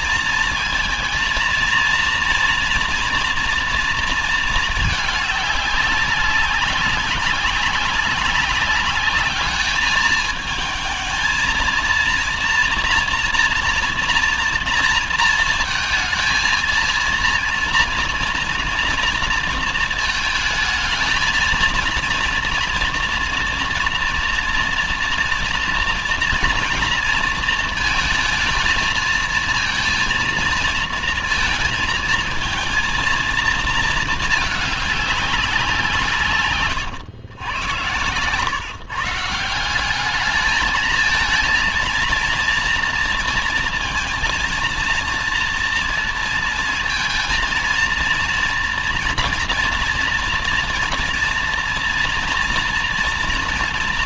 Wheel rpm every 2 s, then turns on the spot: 230, 230, 210, 200, 200, 220, 230, 230, 230, 230, 220, 230, 230, 230, 230, 230, 230, 200, 110, 150, 220, 230, 230, 230, 230, 230, 230.
none